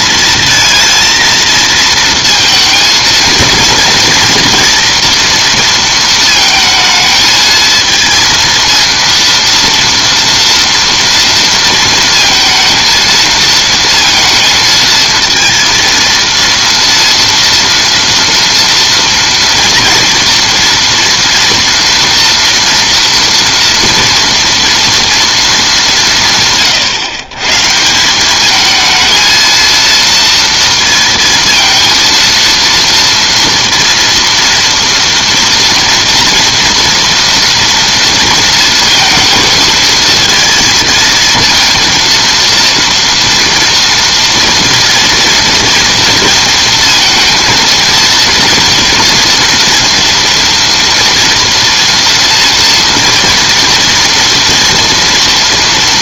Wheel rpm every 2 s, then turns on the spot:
230, 230, 240, 220, 230, 230, 230, 230, 230, 230, 230, 240, 230, 150, 220, 230, 230, 230, 230, 230, 230, 230, 230, 230, 230, 230, 230, 230.
none